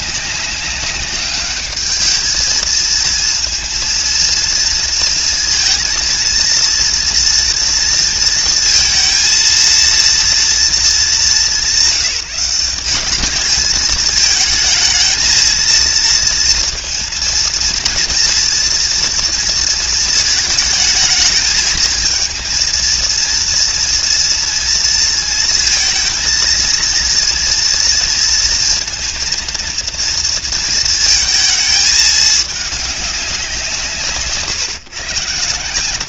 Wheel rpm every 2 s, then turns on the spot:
190, 220, 230, 230, 230, 220, 190, 220, 230, 230, 220, 230, 230, 230, 230, 230, 200, 150.
none